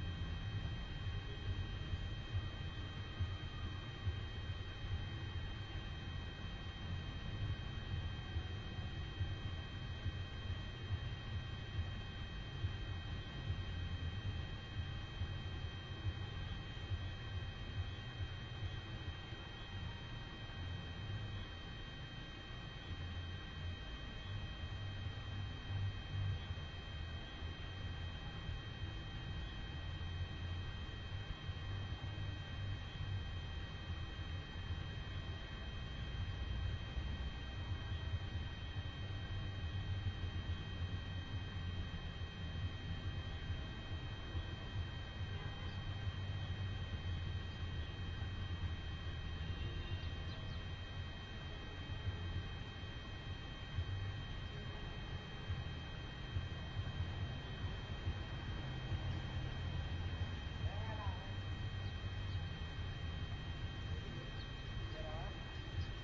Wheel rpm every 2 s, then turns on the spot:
0, 0, 0, 0, 0, 0, 0, 0, 0, 0, 0, 0, 0, 0, 0, 0, 0, 0, 0, 0, 0, 0, 0, 0, 0, 0, 0, 0, 0, 0, 0, 0, 0.
none